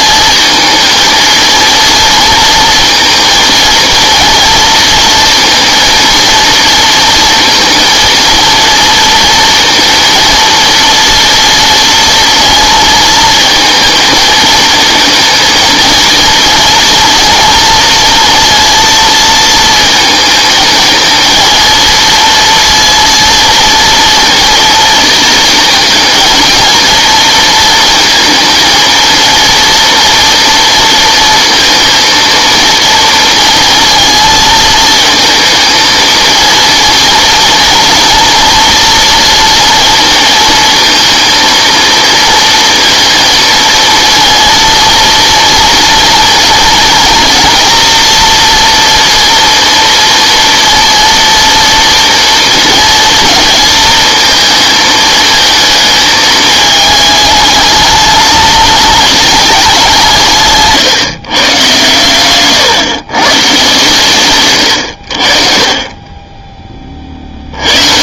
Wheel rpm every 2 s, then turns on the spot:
230, 230, 230, 230, 230, 230, 230, 220, 230, 230, 220, 230, 230, 230, 230, 230, 230, 230, 230, 240, 230, 230, 230, 230, 230, 230, 230, 220, 220, 210, 140, 130, 110, 20.
none